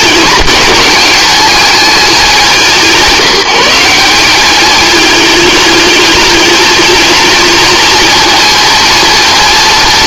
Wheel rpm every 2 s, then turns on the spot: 210, 170, 220, 230, 230.
none